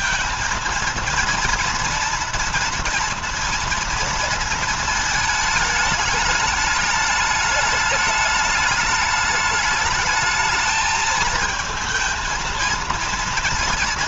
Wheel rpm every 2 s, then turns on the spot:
230, 230, 230, 210, 210, 220, 230.
none